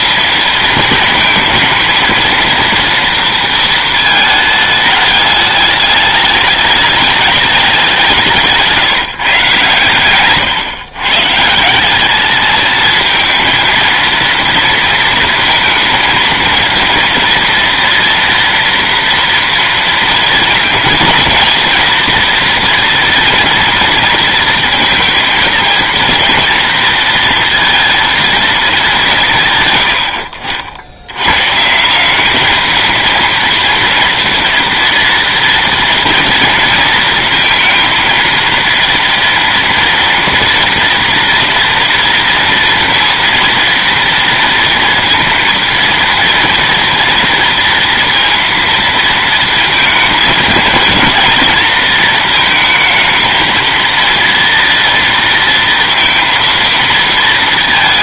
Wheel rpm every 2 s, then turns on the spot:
220, 230, 210, 210, 140, 130, 220, 230, 230, 230, 220, 240, 230, 230, 170, 90, 230, 230, 230, 230, 230, 230, 230, 230, 220, 220, 220, 230, 230.
none